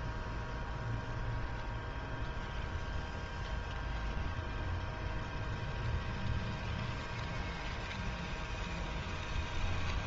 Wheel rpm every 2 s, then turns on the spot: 0, 0, 0, 0, 0.
none